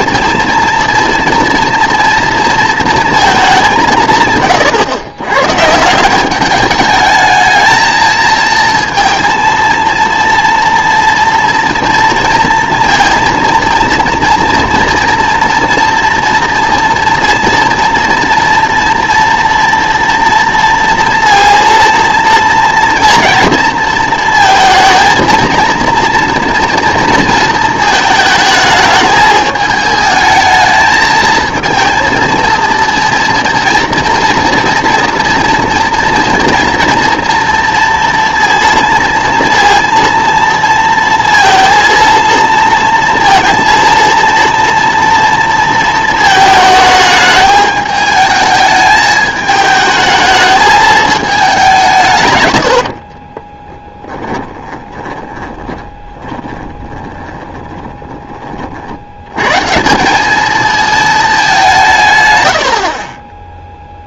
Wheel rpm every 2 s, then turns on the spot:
230, 230, 120, 210, 230, 230, 230, 230, 230, 230, 230, 230, 230, 230, 210, 220, 230, 230, 230, 230, 230, 230, 230, 220, 210, 220, 90, 20, 20, 50, 220, 70.
52-58